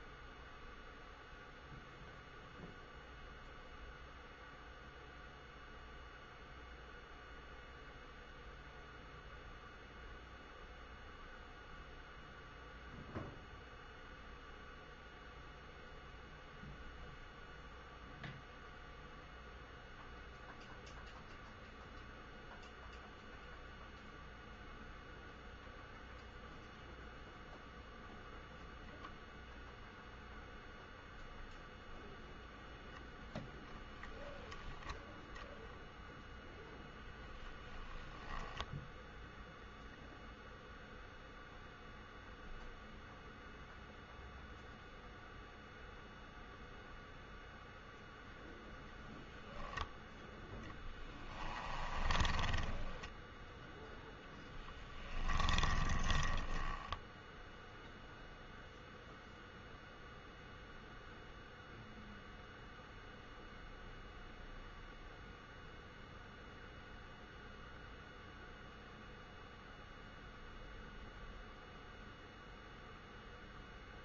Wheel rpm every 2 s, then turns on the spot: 0, 0, 0, 0, 0, 0, 0, 0, 0, 0, 0, 0, 0, 0, 0, 0, 0, 10, 0, 0, 0, 0, 0, 0, 0, 10, 20, 10, 10, 0, 0, 0, 0, 0, 0, 0, 0.
50-58